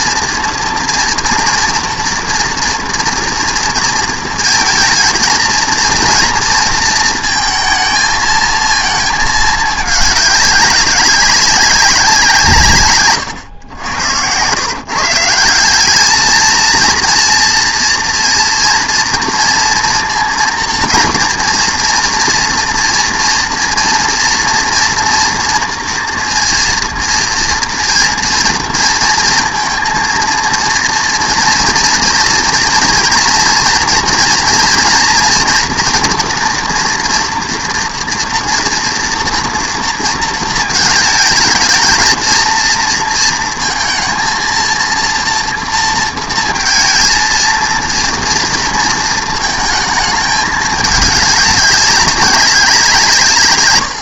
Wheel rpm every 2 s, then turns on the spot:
230, 240, 230, 230, 230, 190, 150, 130, 230, 230, 240, 230, 230, 230, 230, 230, 230, 230, 230, 230, 220, 230, 230, 230, 230, 210, 180.
none